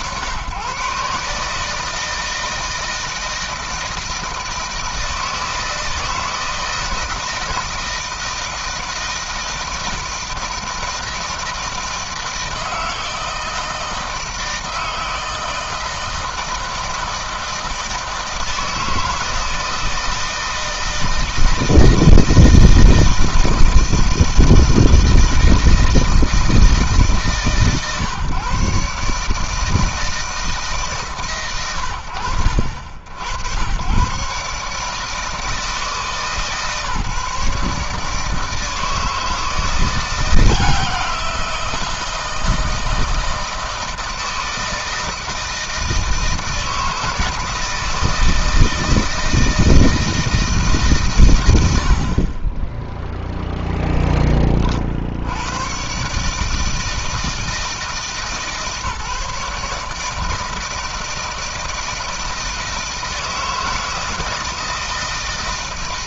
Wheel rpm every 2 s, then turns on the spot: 130, 160, 160, 170, 160, 160, 160, 160, 160, 160, 160, 160, 160, 160, 140, 160, 80, 150, 140, 160, 170, 160, 160, 160, 160, 150, 10, 50, 160, 150, 160, 160, 160.
none